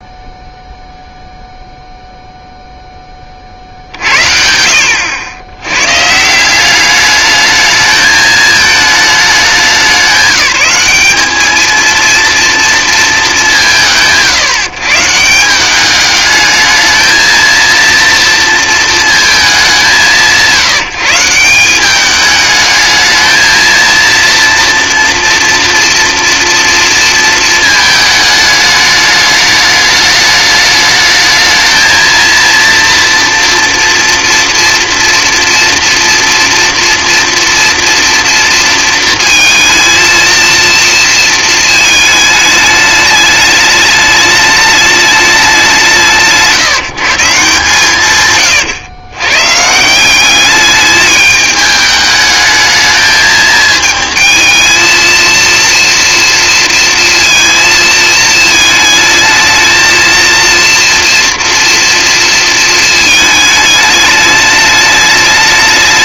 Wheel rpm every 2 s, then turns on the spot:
0, 0, 70, 190, 220, 190, 230, 140, 220, 230, 170, 220, 230, 240, 210, 210, 230, 240, 230, 230, 230, 210, 210, 170, 110, 210, 220, 220, 230, 220, 230, 220, 210.
none